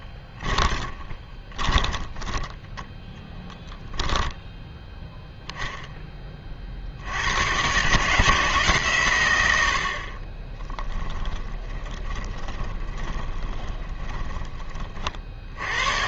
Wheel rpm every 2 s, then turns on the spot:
20, 10, 0, 40, 140, 20, 20, 30.
0-4 10-14